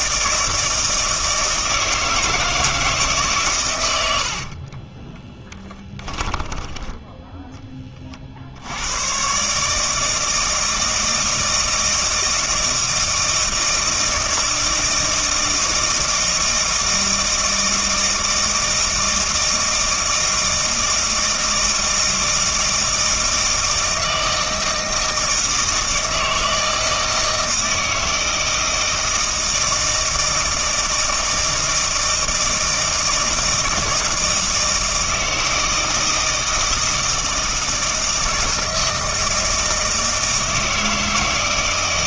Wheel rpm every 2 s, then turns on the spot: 160, 160, 60, 10, 70, 160, 160, 160, 160, 160, 160, 160, 160, 160, 160, 160, 160, 160, 160, 160, 160.
4-8